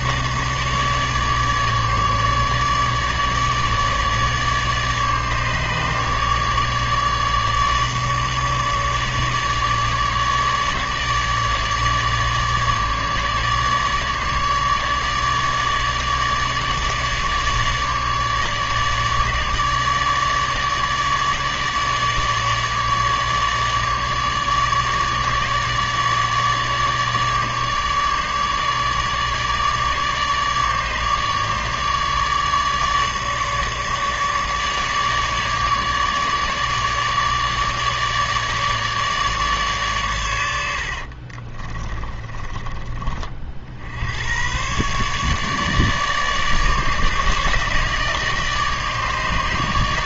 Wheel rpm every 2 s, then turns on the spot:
150, 150, 150, 150, 150, 150, 150, 150, 150, 150, 150, 150, 150, 150, 150, 150, 150, 150, 150, 150, 80, 20, 130, 150, 150.
none